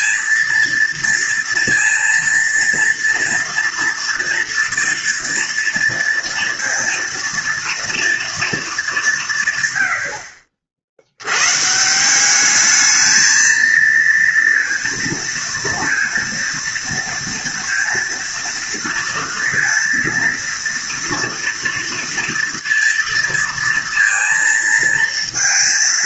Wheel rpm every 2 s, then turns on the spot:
230, 230, 230, 230, 220, 60, 210, 230, 230, 230, 230, 230, 230.
none